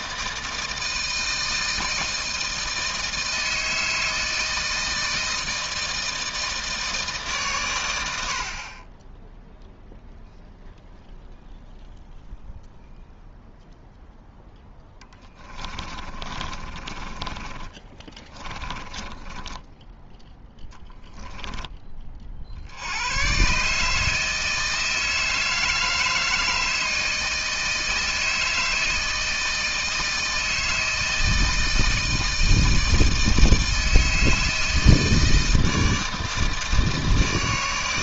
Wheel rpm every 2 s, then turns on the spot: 160, 160, 160, 160, 30, 0, 0, 10, 30, 20, 0, 80, 160, 160, 160, 160, 160, 160, 160.
14-20